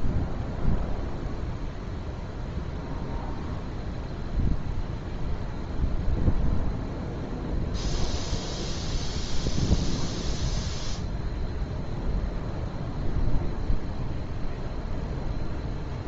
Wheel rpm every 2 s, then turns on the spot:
0, 0, 0, 0, 0, 0, 0, 0.
none